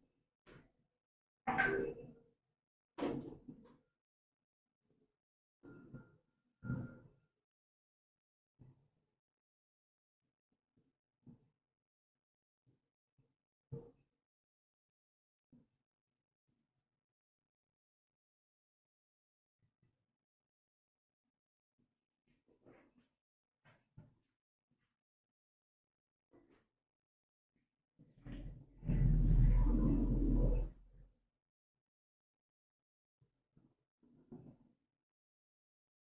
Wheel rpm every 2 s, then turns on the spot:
0, 0, 0, 0, 0, 0, 0, 0, 0, 0, 0, 0, 0, 0, 0, 0, 0, 0.
none